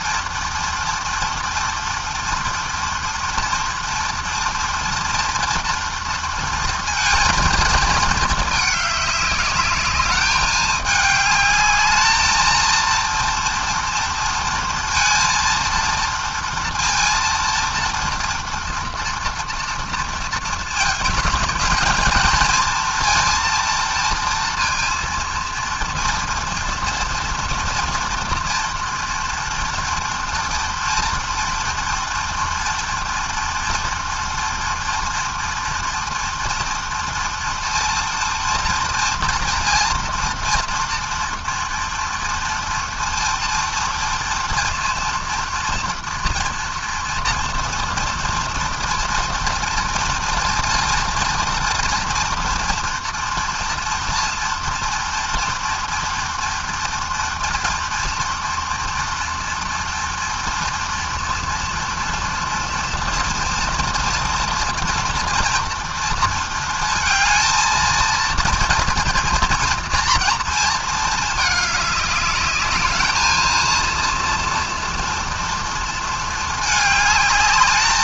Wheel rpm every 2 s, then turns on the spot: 230, 230, 240, 220, 200, 210, 230, 230, 230, 240, 220, 230, 230, 230, 230, 230, 230, 230, 230, 230, 240, 230, 240, 230, 230, 230, 230, 230, 230, 230, 230, 230, 230, 230, 230, 210, 220, 240, 220.
none